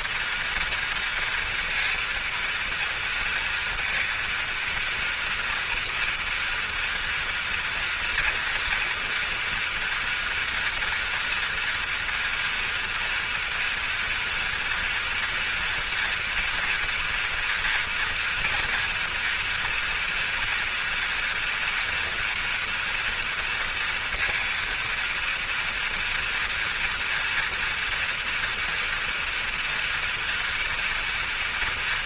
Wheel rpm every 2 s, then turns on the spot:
230, 230, 230, 230, 230, 240, 240, 230, 230, 230, 230, 230, 230, 230, 230, 230.
none